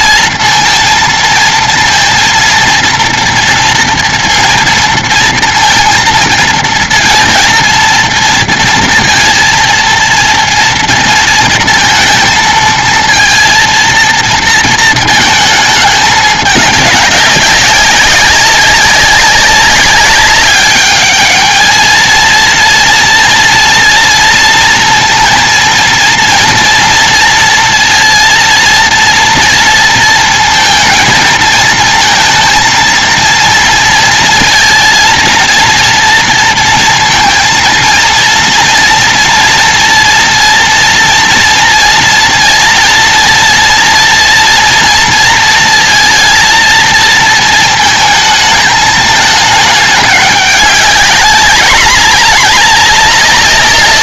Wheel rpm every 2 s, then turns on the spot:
230, 230, 230, 230, 230, 230, 230, 230, 210, 190, 200, 230, 230, 230, 230, 230, 230, 230, 240, 230, 230, 230, 230, 230, 220, 210, 200.
none